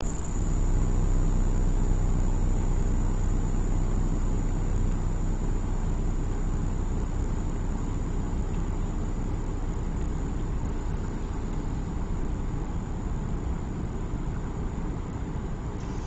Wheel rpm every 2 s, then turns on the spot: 0, 0, 0, 0, 0, 0, 0, 0.
none